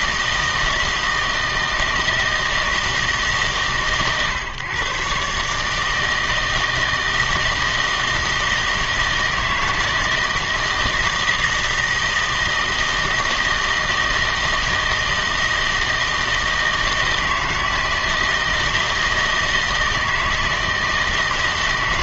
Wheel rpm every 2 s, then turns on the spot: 160, 160, 130, 160, 160, 160, 160, 160, 160, 160, 160.
none